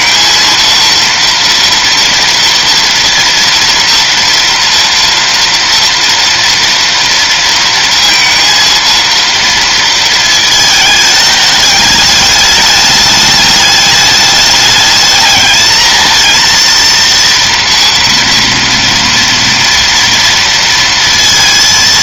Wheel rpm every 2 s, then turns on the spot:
230, 230, 230, 230, 230, 220, 210, 210, 230, 230, 230.
none